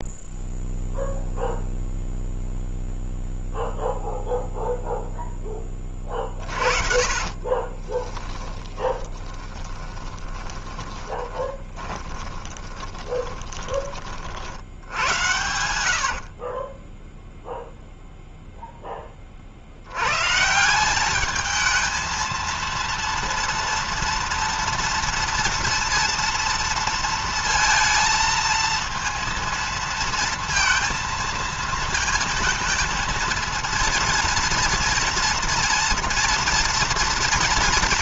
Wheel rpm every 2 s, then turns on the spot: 0, 0, 0, 40, 10, 20, 20, 70, 30, 10, 170, 230, 230, 230, 230, 230, 230, 230, 230.
6-18